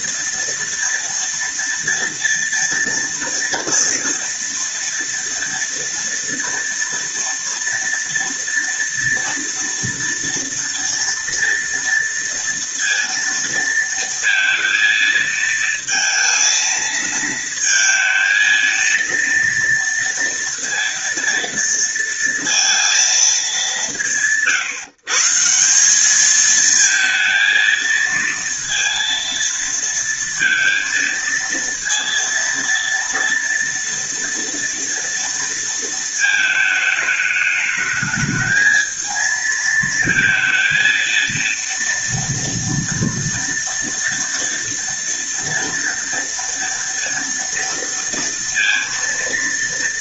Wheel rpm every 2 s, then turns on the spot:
230, 230, 230, 230, 230, 230, 230, 230, 230, 230, 230, 230, 160, 220, 230, 230, 230, 230, 220, 220, 230, 230, 230, 230, 230.
none